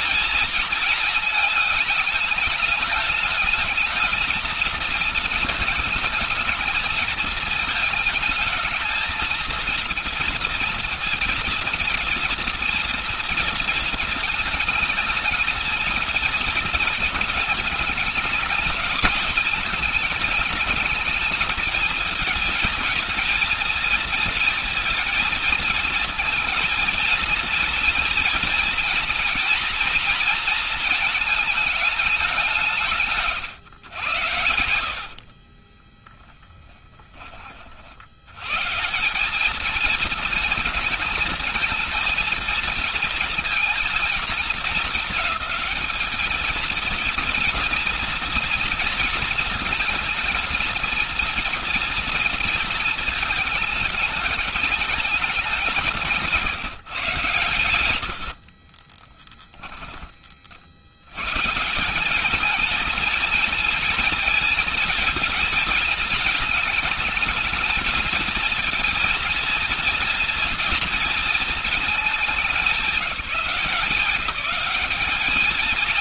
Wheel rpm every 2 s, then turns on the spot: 230, 210, 220, 220, 220, 240, 230, 220, 220, 220, 210, 220, 230, 230, 240, 230, 170, 70, 10, 120, 230, 230, 210, 220, 230, 230, 230, 210, 160, 40, 70, 220, 230, 220, 230, 220, 200, 210.
34-36 58-60